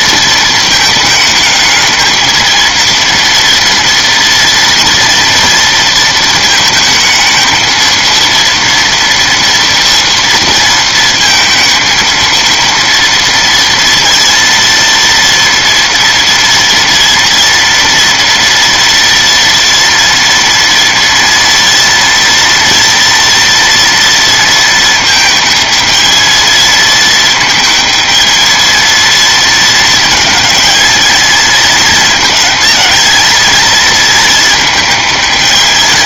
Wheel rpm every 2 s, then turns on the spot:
220, 220, 230, 220, 230, 230, 230, 230, 230, 230, 230, 230, 220, 220, 220, 220, 220, 220.
none